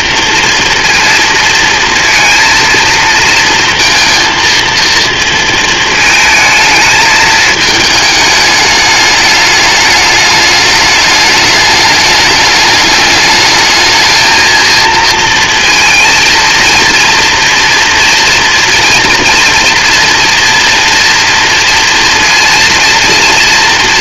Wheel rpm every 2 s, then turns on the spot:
230, 230, 230, 220, 210, 210, 210, 230, 230, 230, 240, 230.
none